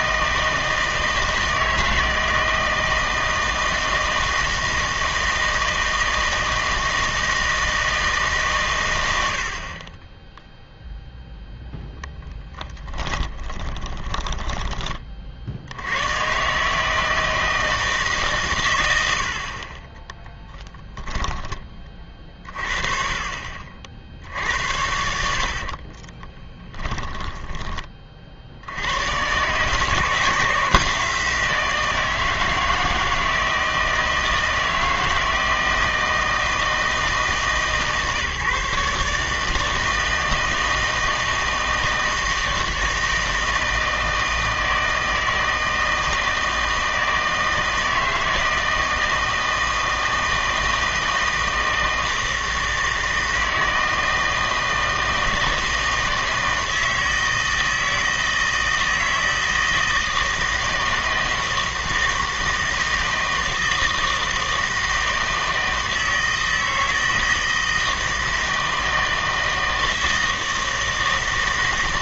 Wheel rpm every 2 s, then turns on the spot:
160, 160, 160, 160, 120, 0, 10, 20, 150, 130, 10, 40, 80, 10, 80, 170, 160, 160, 160, 140, 160, 160, 160, 160, 160, 160, 160, 160, 160, 160, 160, 160, 160, 160, 160, 160.
12-14 20-22 24-28